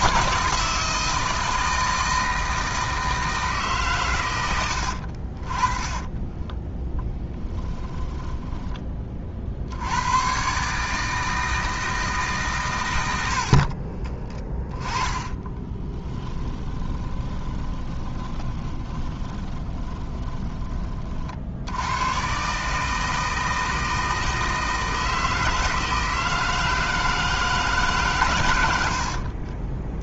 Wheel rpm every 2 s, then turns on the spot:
160, 160, 70, 10, 20, 150, 120, 20, 20, 20, 30, 150, 160, 160, 90.
14-20 28-30